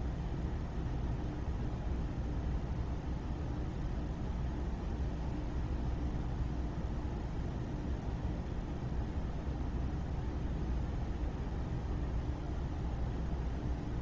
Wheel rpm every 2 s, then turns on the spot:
0, 0, 0, 0, 0, 0, 0.
none